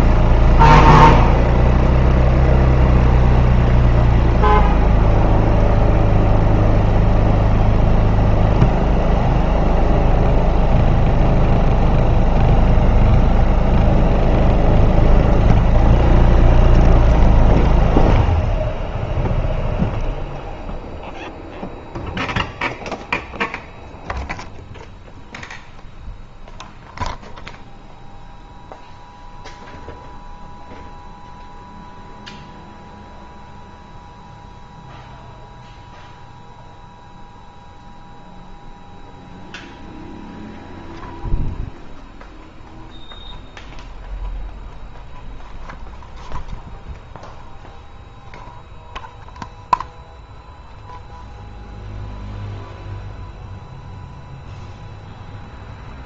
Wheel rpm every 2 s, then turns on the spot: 0, 0, 0, 0, 0, 0, 0, 0, 0, 0, 0, 0, 0, 0, 0, 0, 0, 0, 0, 0, 0, 0, 0, 0, 0, 0, 0, 0.
none